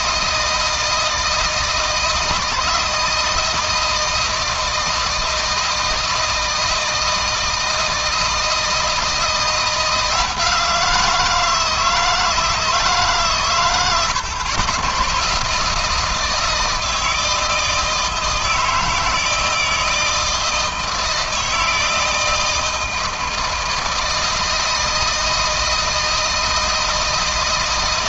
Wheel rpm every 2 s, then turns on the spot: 160, 160, 160, 160, 160, 170, 150, 110, 160, 160, 160, 160, 160, 160.
none